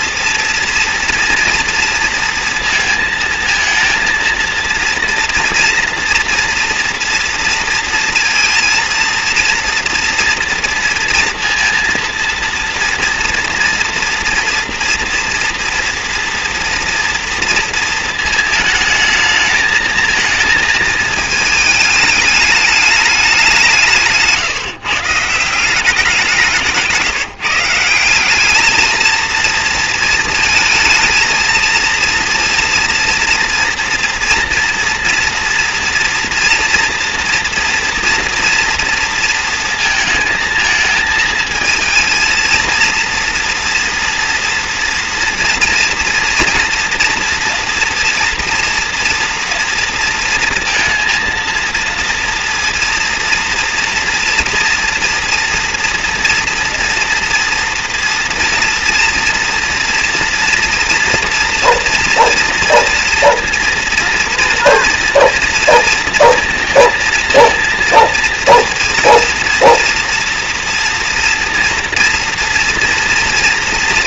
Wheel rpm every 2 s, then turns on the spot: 230, 230, 230, 240, 230, 230, 230, 230, 230, 220, 220, 210, 160, 180, 210, 220, 230, 230, 230, 230, 220, 230, 230, 240, 230, 230, 240, 230, 240, 230, 230, 230, 240, 230, 230, 230, 230.
none